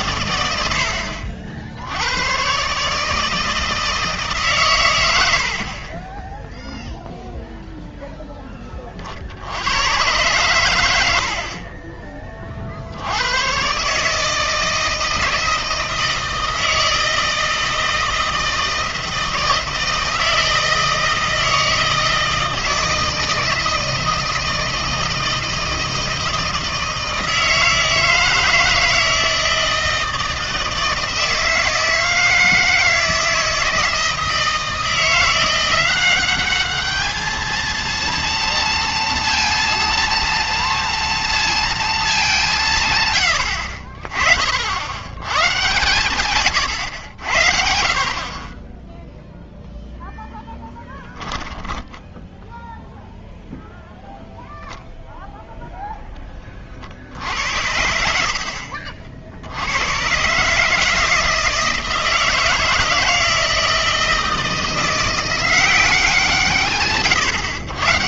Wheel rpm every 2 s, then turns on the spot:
90, 140, 130, 0, 10, 100, 70, 160, 160, 160, 160, 160, 160, 160, 160, 160, 160, 170, 210, 230, 230, 160, 60, 110, 20, 20, 0, 0, 30, 60, 150, 160, 170, 150.
46-48 50-52 58-60